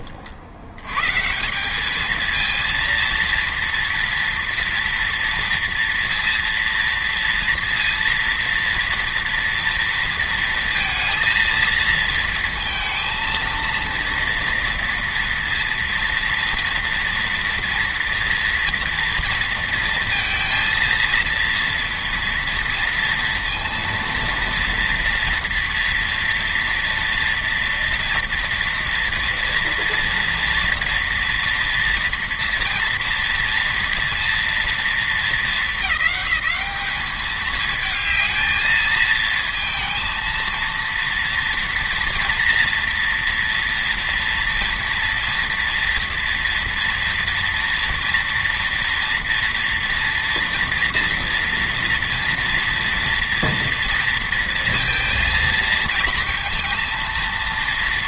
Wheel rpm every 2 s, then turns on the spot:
100, 230, 230, 230, 230, 230, 230, 230, 230, 230, 230, 230, 230, 230, 230, 230, 230, 220, 210, 220, 230, 230, 230, 240, 230, 240, 230, 230, 230.
none